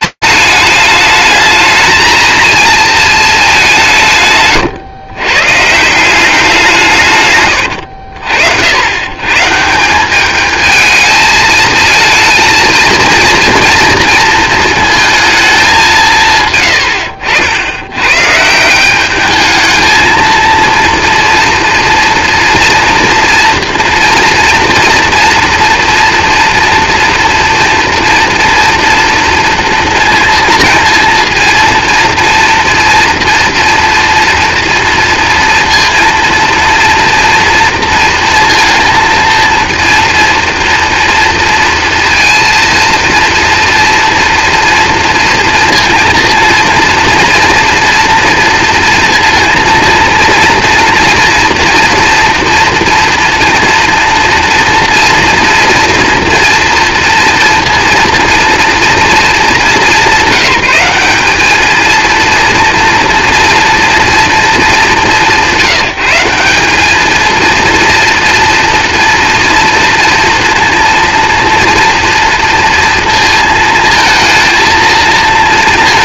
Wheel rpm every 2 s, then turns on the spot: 210, 230, 130, 170, 80, 220, 230, 230, 110, 180, 230, 230, 230, 230, 240, 230, 240, 230, 230, 230, 230, 230, 230, 230, 230, 230, 230, 240, 230, 240, 200, 230, 210, 200, 240, 230, 230, 230.
none